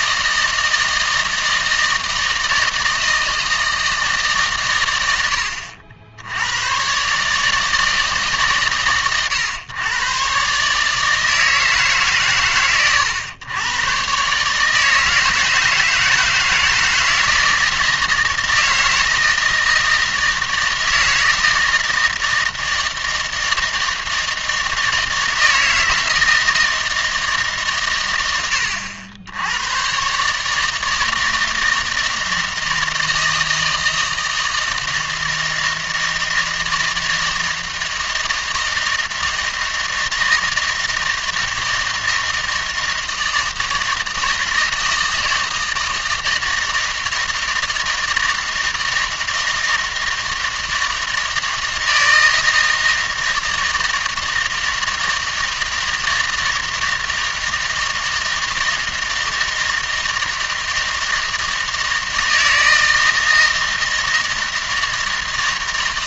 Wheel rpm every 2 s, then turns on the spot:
160, 160, 120, 110, 130, 140, 110, 150, 160, 160, 160, 160, 160, 160, 80, 160, 160, 160, 160, 160, 160, 160, 160, 160, 160, 160, 160, 160, 160, 160, 160, 160, 160.
none